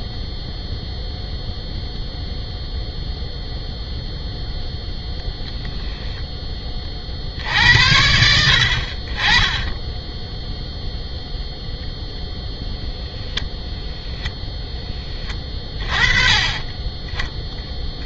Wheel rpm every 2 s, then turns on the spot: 0, 0, 0, 30, 50, 0, 0, 10, 20.
none